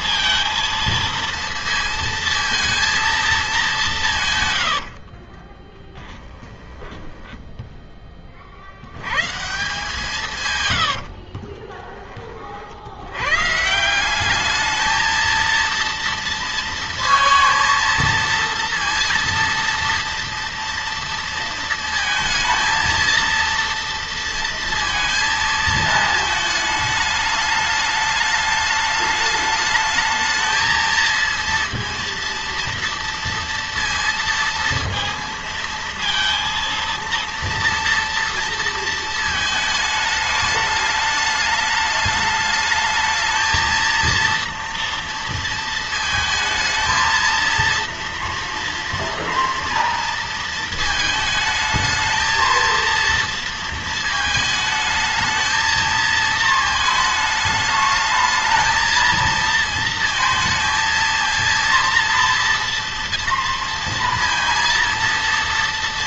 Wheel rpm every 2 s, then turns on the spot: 230, 230, 100, 10, 50, 120, 50, 210, 230, 230, 230, 230, 230, 220, 210, 220, 230, 230, 230, 230, 210, 210, 230, 220, 230, 230, 220, 220, 220, 220, 230, 230, 230.
4-8 10-12